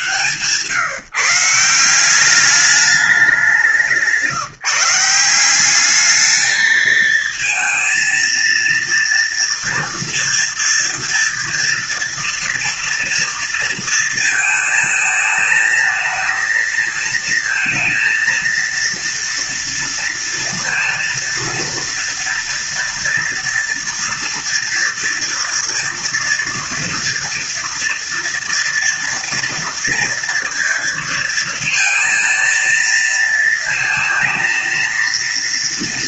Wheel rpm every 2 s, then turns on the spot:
150, 210, 170, 220, 230, 230, 230, 220, 230, 230, 230, 230, 230, 240, 230, 230, 230, 230.
none